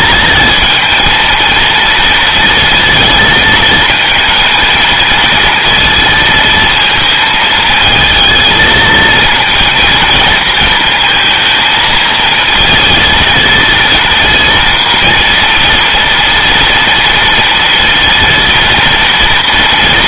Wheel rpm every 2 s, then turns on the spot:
230, 230, 230, 230, 220, 230, 220, 230, 230, 230.
none